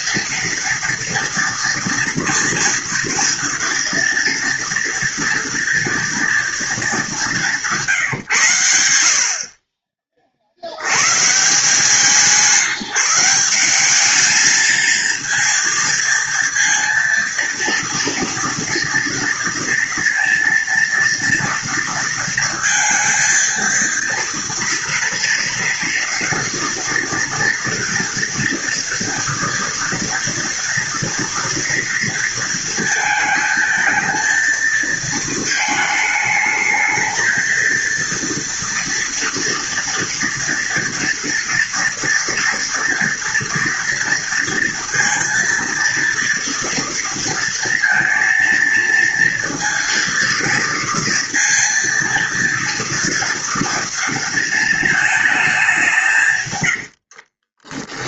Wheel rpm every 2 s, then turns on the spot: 230, 240, 230, 220, 90, 90, 170, 220, 230, 230, 230, 230, 230, 230, 230, 230, 230, 220, 220, 230, 230, 230, 230, 230, 230, 230, 230, 220, 100.
none